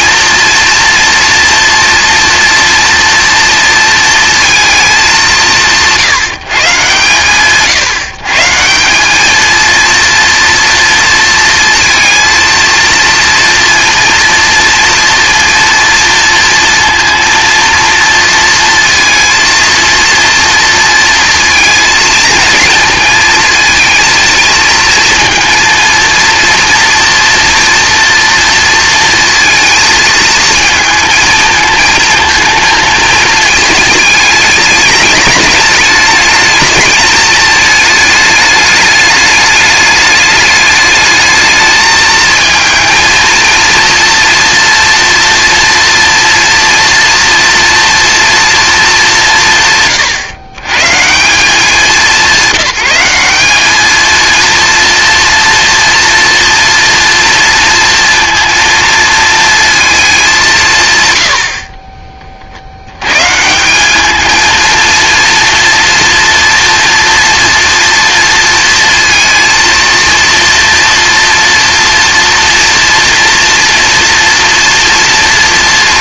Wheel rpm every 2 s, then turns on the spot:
240, 230, 210, 140, 180, 230, 230, 230, 230, 230, 230, 230, 230, 230, 230, 220, 220, 210, 220, 210, 210, 230, 240, 230, 220, 130, 180, 230, 230, 230, 150, 90, 230, 230, 230, 230, 230, 230.
none